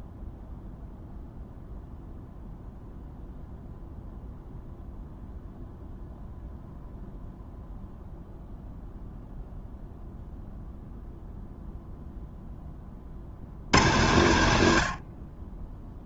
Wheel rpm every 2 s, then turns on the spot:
0, 0, 0, 0, 0, 0, 50, 60.
none